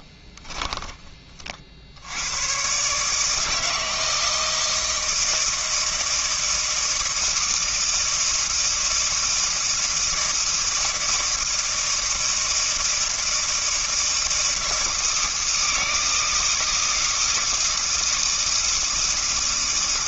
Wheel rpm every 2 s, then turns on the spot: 30, 130, 160, 160, 160, 160, 160, 160, 160, 160.
0-2